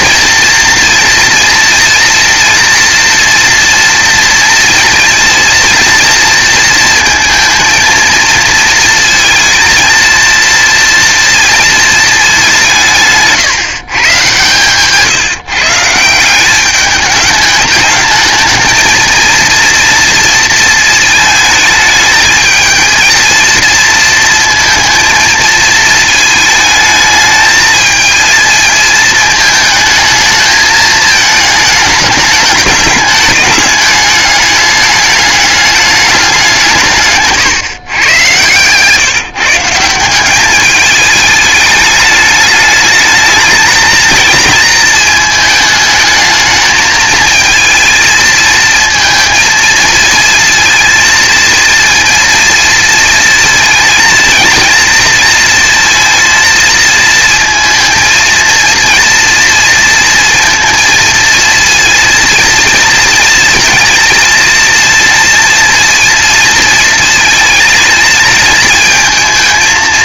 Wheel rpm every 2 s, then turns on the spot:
230, 230, 230, 230, 230, 230, 170, 130, 200, 230, 230, 220, 230, 220, 220, 220, 210, 210, 170, 130, 210, 210, 220, 220, 220, 230, 230, 230, 220, 230, 230, 230, 230, 230, 220.
none